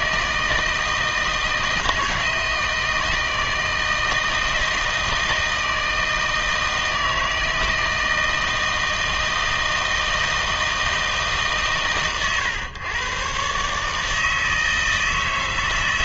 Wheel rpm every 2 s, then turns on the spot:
160, 160, 160, 160, 160, 160, 120, 160.
none